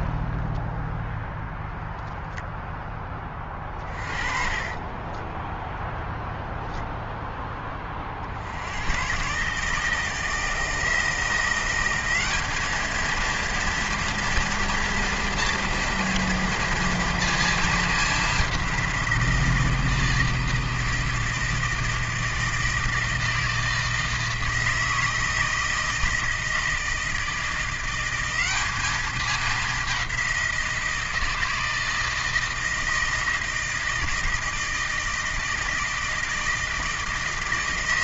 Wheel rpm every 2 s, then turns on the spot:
0, 0, 20, 10, 80, 160, 210, 230, 230, 190, 160, 160, 160, 160, 200, 180, 160, 160, 160.
4-6